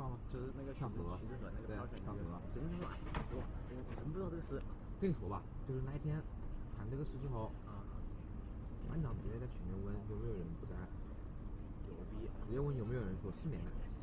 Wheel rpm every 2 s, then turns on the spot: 0, 0, 0, 0, 0, 0, 0.
none